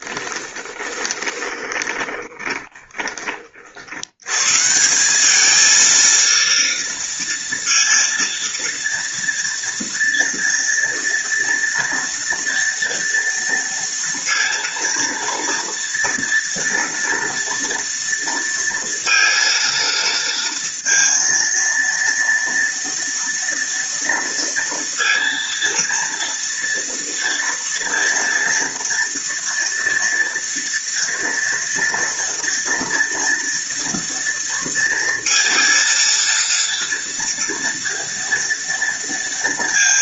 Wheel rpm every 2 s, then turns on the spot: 20, 40, 200, 230, 230, 230, 230, 230, 230, 230, 230, 230, 230, 230, 230, 230, 230, 230, 230, 230.
0-2